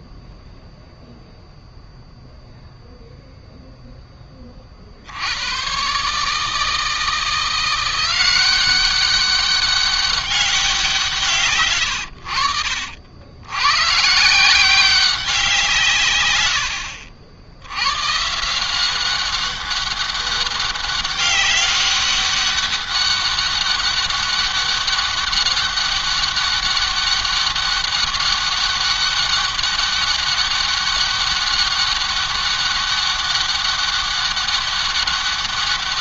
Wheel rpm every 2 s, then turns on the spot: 0, 0, 30, 150, 180, 190, 70, 160, 90, 160, 200, 200, 200, 200, 200, 200, 200, 200.
none